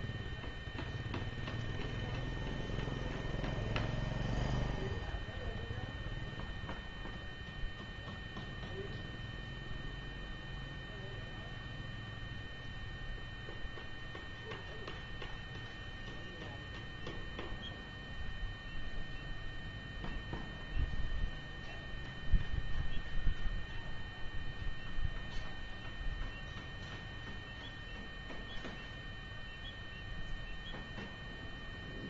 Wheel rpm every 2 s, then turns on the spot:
0, 0, 0, 0, 0, 0, 0, 0, 0, 0, 0, 0, 0, 0, 0, 0.
none